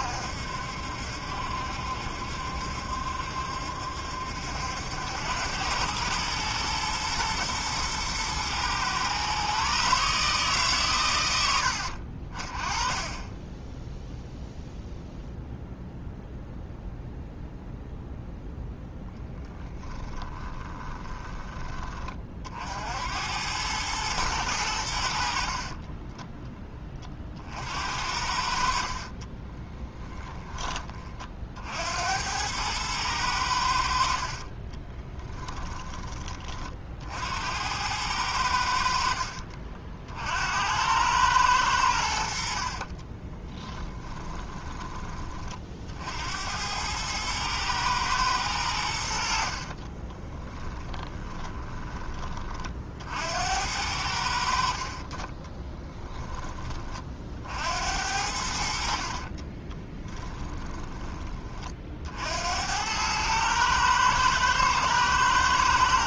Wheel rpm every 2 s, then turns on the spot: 70, 70, 80, 110, 120, 130, 40, 0, 0, 0, 10, 60, 90, 20, 50, 30, 100, 20, 40, 70, 90, 40, 20, 100, 90, 20, 50, 40, 30, 70, 20, 90, 110.
20-22 28-30 34-36 42-44 50-52 58-62